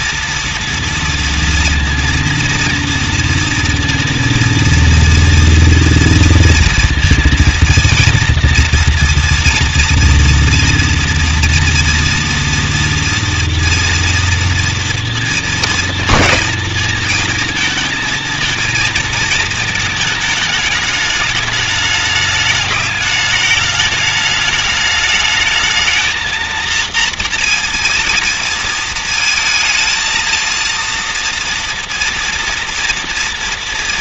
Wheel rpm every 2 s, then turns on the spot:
230, 230, 230, 230, 230, 230, 230, 230, 230, 230, 210, 210, 210, 230, 230, 230, 230.
none